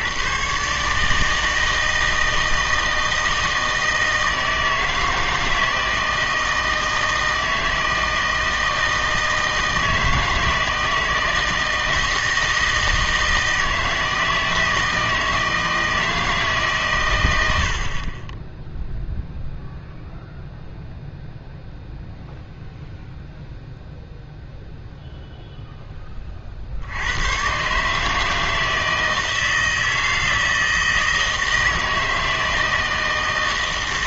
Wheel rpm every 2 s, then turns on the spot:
140, 160, 160, 160, 160, 160, 160, 160, 140, 0, 0, 0, 0, 70, 160, 160, 160.
none